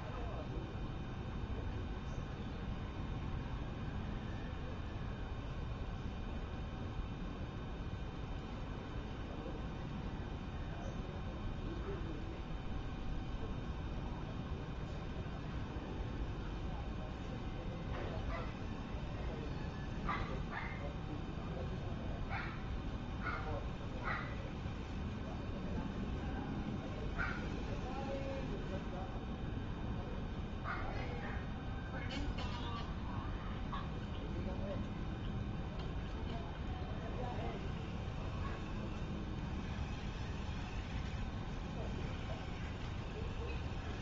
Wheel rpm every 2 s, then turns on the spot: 0, 0, 0, 0, 0, 0, 0, 0, 0, 0, 0, 0, 0, 0, 0, 0, 0, 0, 0, 0, 0, 0.
none